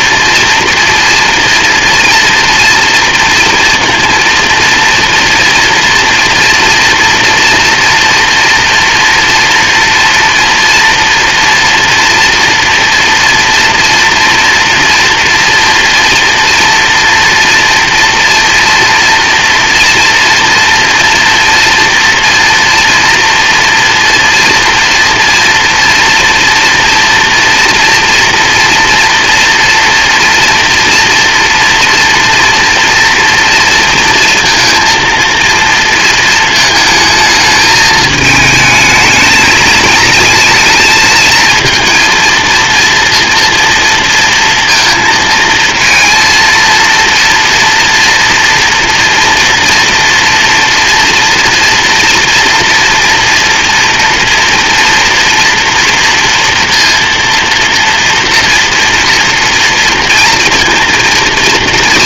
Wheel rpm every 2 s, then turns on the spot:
230, 240, 230, 230, 230, 230, 230, 240, 230, 230, 230, 230, 230, 230, 230, 230, 230, 230, 220, 220, 220, 230, 230, 240, 230, 230, 230, 230, 230, 230, 230.
none